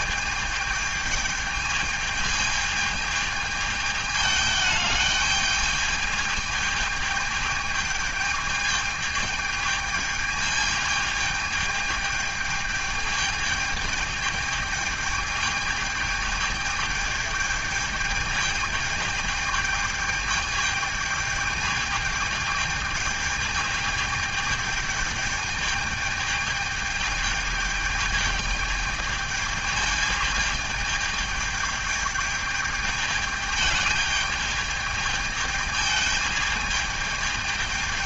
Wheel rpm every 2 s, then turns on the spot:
210, 220, 210, 210, 210, 210, 210, 210, 210, 210, 210, 210, 210, 210, 210, 210, 210, 210, 210.
none